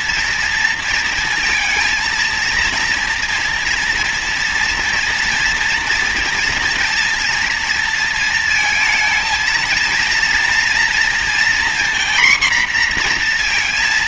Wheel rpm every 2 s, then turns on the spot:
230, 230, 230, 230, 230, 230, 240.
none